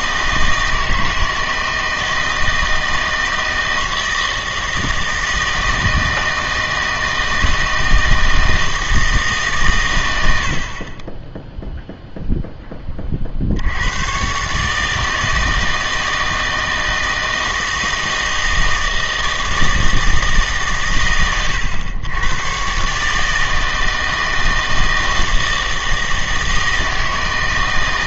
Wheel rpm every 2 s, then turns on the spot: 160, 160, 160, 160, 160, 60, 10, 150, 160, 160, 150, 120, 160, 160.
none